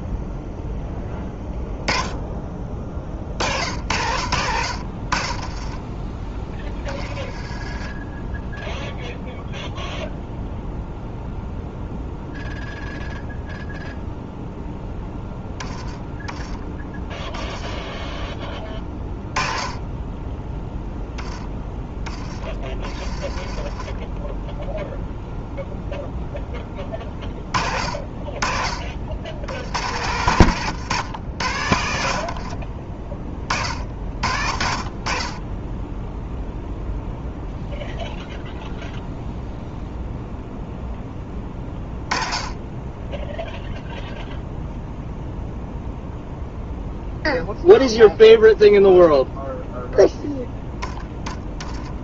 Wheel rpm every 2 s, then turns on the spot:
0, 30, 60, 20, 0, 0, 0, 0, 10, 10, 10, 20, 0, 10, 40, 120, 50, 50, 0, 0, 0, 20, 0, 0, 0, 10.
30-34